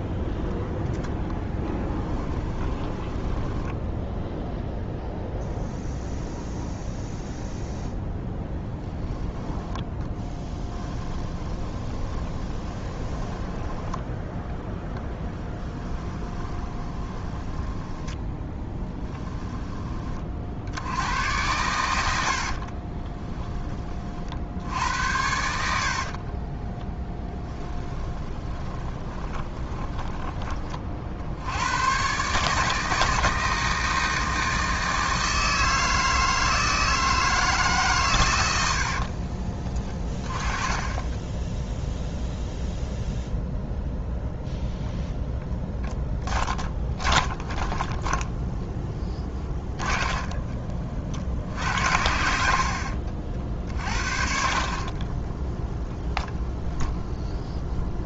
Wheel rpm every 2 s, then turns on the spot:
0, 10, 0, 0, 20, 20, 20, 10, 20, 10, 70, 30, 80, 20, 20, 40, 150, 160, 160, 80, 10, 0, 0, 10, 10, 30, 60, 40, 0.
2-4 10-14 16-20 22-24 26-30 38-40 46-50 52-56